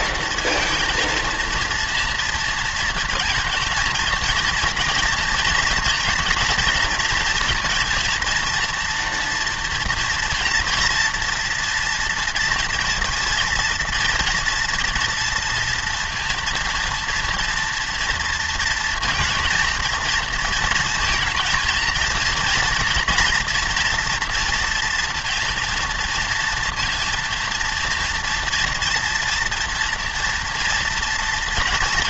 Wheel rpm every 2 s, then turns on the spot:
230, 230, 230, 230, 230, 240, 230, 230, 230, 230, 230, 230, 230, 230, 230, 240.
none